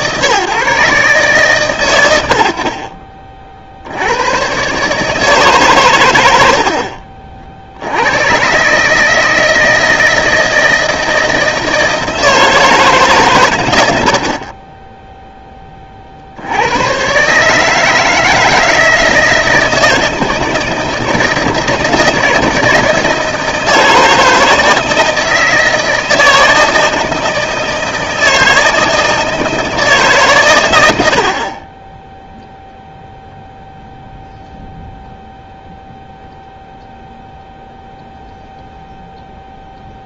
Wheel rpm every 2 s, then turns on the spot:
140, 40, 140, 60, 150, 160, 150, 10, 110, 160, 160, 160, 160, 160, 160, 90, 0, 0, 0, 0.
6-8